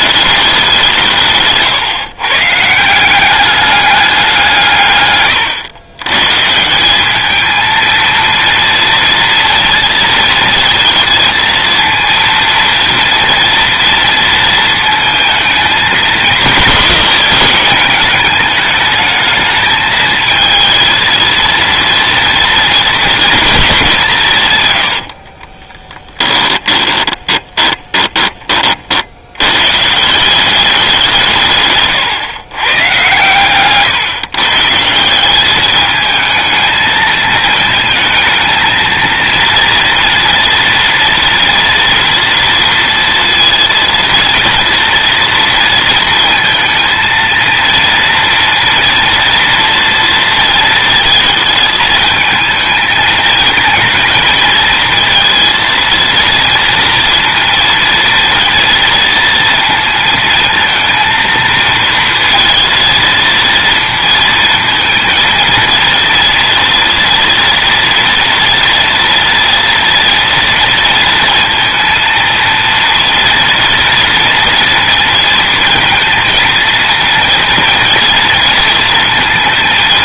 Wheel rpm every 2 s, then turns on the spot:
180, 160, 140, 180, 230, 230, 230, 220, 200, 210, 220, 230, 110, 20, 40, 190, 130, 150, 220, 230, 240, 230, 230, 220, 230, 230, 220, 220, 230, 230, 230, 230, 230, 240, 230, 230, 230, 230, 230, 230.
24-28